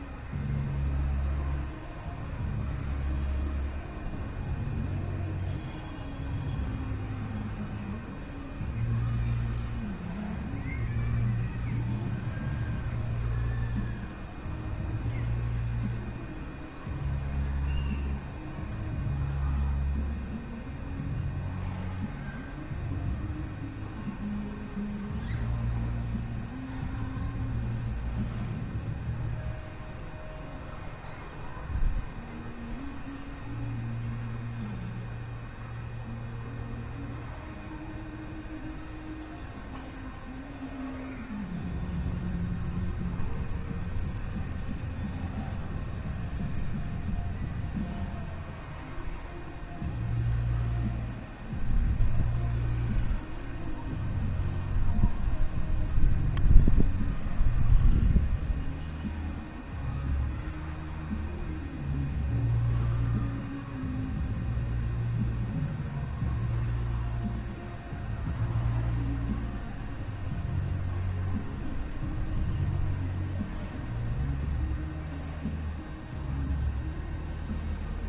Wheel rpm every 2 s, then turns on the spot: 0, 0, 0, 0, 0, 0, 0, 0, 0, 0, 0, 0, 0, 0, 0, 0, 0, 0, 0, 0, 0, 0, 0, 0, 0, 0, 0, 0, 0, 0, 0, 0, 0, 0, 0, 0, 0, 0, 0.
none